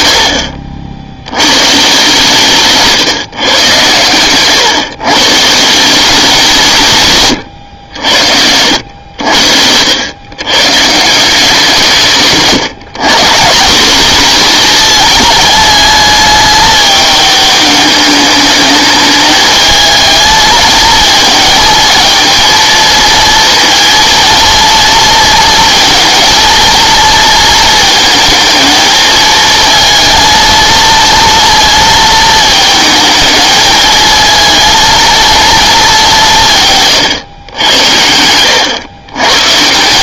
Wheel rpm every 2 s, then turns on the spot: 50, 150, 130, 170, 80, 140, 150, 220, 210, 210, 220, 230, 230, 230, 220, 230, 220, 220, 150, 100.
8-10